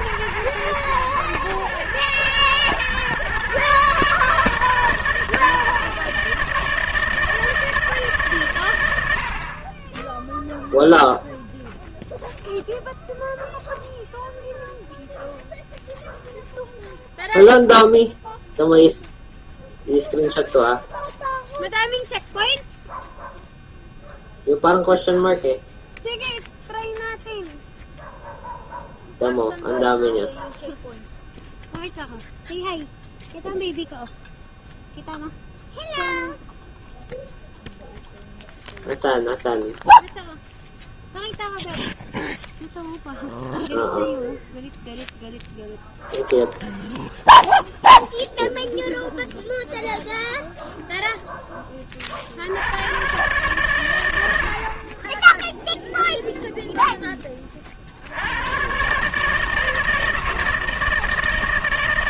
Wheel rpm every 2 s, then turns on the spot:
110, 120, 160, 160, 130, 0, 0, 0, 0, 0, 0, 0, 0, 0, 0, 0, 0, 0, 0, 0, 0, 0, 0, 0, 0, 0, 80, 70, 0, 110, 160.
none